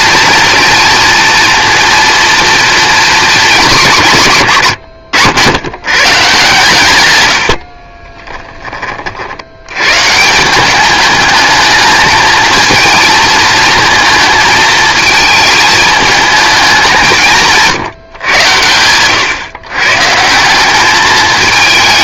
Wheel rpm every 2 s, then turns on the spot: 230, 240, 130, 140, 40, 200, 230, 220, 200, 100, 210.
none